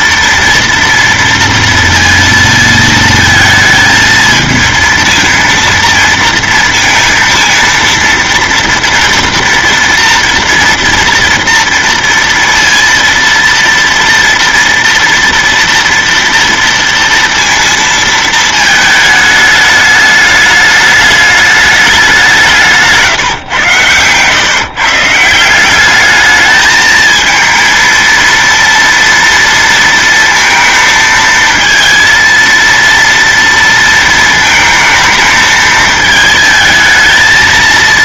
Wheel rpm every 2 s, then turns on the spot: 230, 230, 230, 230, 230, 240, 230, 230, 230, 220, 210, 170, 140, 210, 230, 230, 230, 220, 220.
none